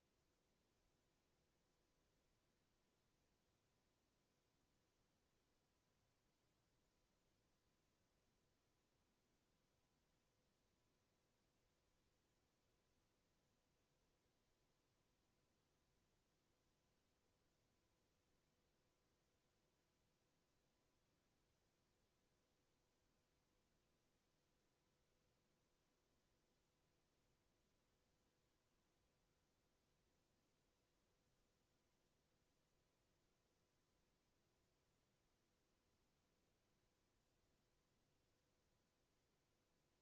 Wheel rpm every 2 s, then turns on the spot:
0, 0, 0, 0, 0, 0, 0, 0, 0, 0, 0, 0, 0, 0, 0, 0, 0, 0, 0, 0.
none